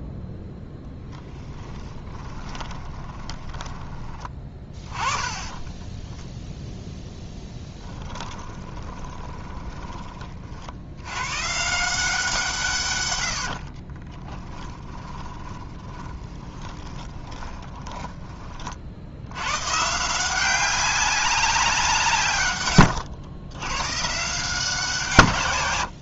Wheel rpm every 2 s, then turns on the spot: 10, 20, 20, 10, 20, 80, 130, 10, 20, 50, 190, 120, 170.
2-6 8-10 14-18 22-24